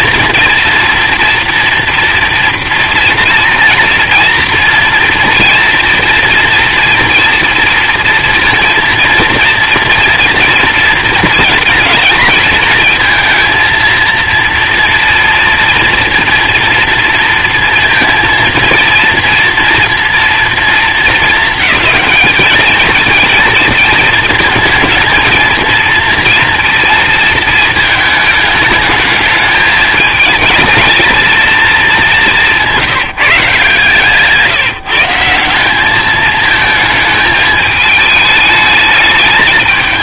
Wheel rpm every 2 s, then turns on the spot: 240, 230, 230, 230, 230, 230, 220, 230, 230, 230, 230, 210, 220, 230, 220, 220, 190, 150, 220, 210.
none